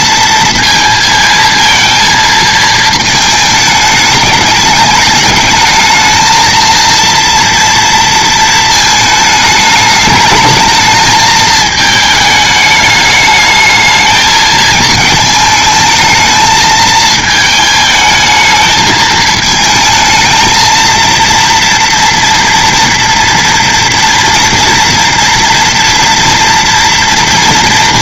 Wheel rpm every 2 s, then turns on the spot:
230, 230, 210, 220, 220, 220, 210, 220, 220, 220, 230, 230, 230, 230.
none